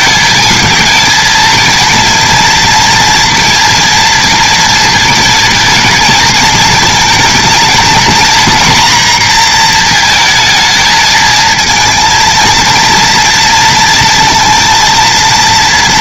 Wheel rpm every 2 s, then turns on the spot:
220, 230, 230, 230, 240, 220, 230, 230.
none